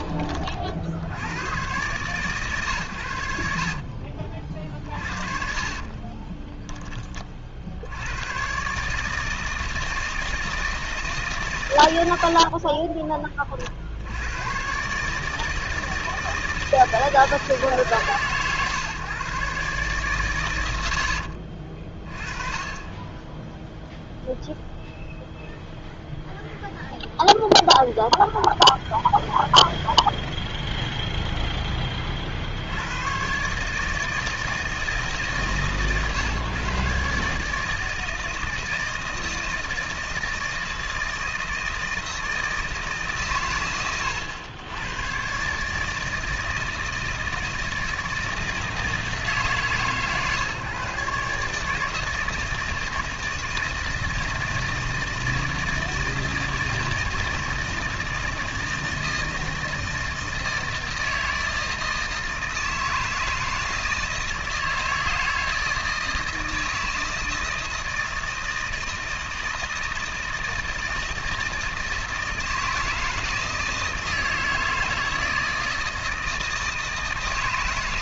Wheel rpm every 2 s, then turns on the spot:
90, 90, 40, 20, 160, 140, 20, 150, 160, 130, 70, 20, 0, 0, 0, 0, 110, 150, 140, 160, 160, 150, 120, 160, 160, 150, 160, 160, 170, 160, 160, 160, 160, 160, 160, 160, 160, 160, 160.
4-6